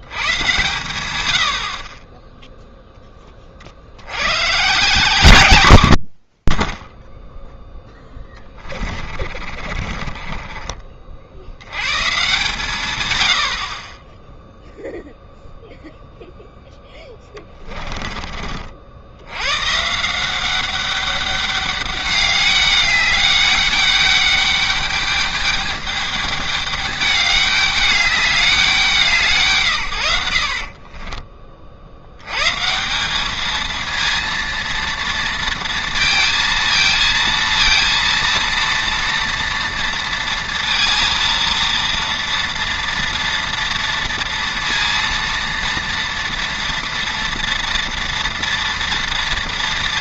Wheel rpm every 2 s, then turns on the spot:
110, 0, 140, 70, 30, 30, 120, 0, 10, 50, 190, 200, 200, 210, 190, 40, 140, 230, 230, 230, 230, 230, 230, 230, 230.
8-12 30-32